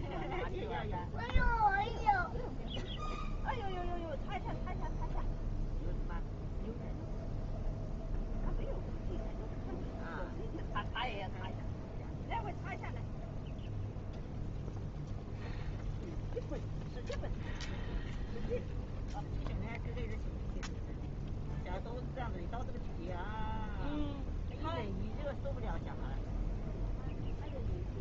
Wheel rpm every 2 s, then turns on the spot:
0, 0, 0, 0, 0, 0, 0, 0, 0, 0, 0, 0, 0, 0.
none